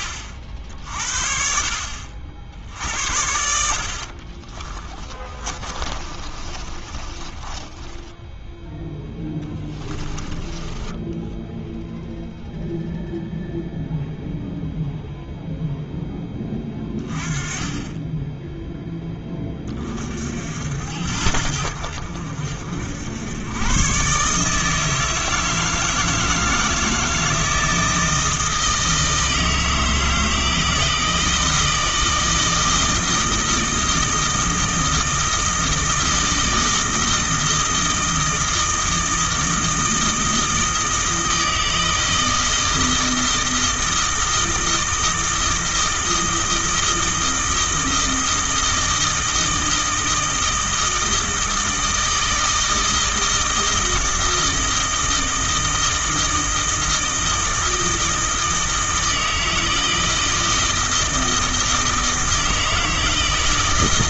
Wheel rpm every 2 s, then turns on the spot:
60, 60, 20, 30, 0, 10, 0, 0, 20, 10, 70, 80, 160, 160, 160, 160, 160, 160, 160, 160, 160, 160, 160, 160, 160, 160, 160, 160, 160, 160, 160, 160.
4-8 10-12